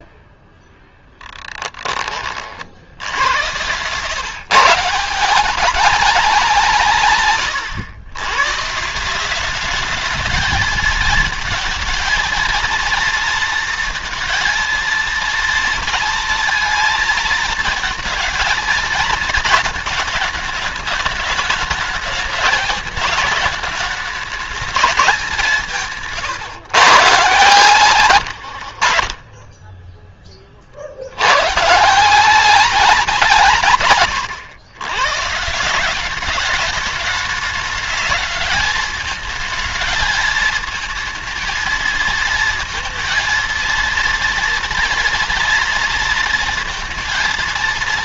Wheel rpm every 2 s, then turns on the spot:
0, 70, 150, 160, 140, 220, 230, 230, 230, 220, 210, 210, 210, 140, 70, 40, 180, 130, 200, 210, 220, 230, 230, 230.
none